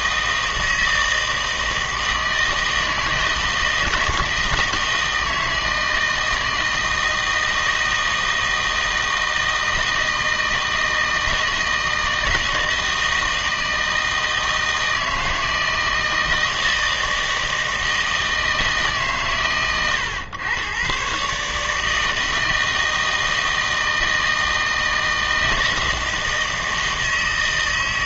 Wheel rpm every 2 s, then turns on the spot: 160, 160, 160, 160, 160, 160, 160, 160, 160, 160, 110, 160, 160, 160.
none